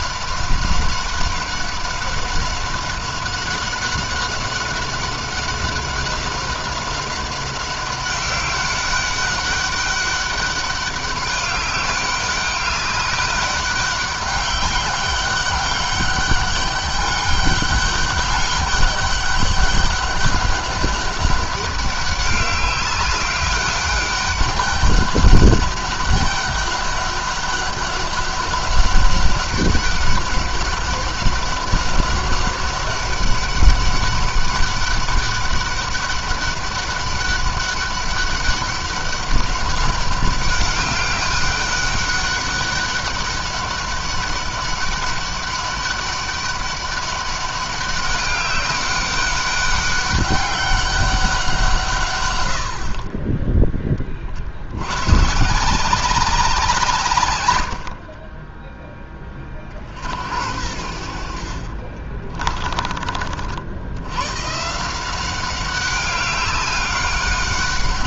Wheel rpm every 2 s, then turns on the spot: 200, 190, 190, 190, 190, 200, 200, 200, 200, 200, 200, 190, 200, 200, 200, 200, 200, 200, 200, 200, 200, 200, 200, 200, 200, 200, 80, 80, 170, 20, 80, 30, 140, 200.
62-64